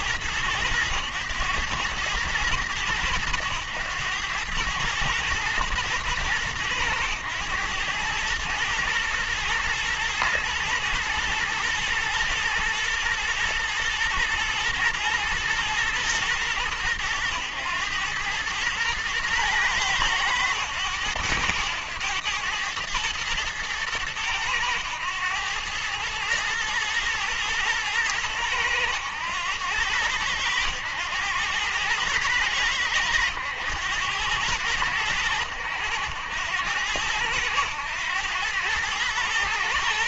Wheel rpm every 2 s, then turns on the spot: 110, 100, 100, 110, 110, 110, 110, 110, 110, 110, 110, 110, 110, 110, 100, 100, 100, 100, 100, 110.
none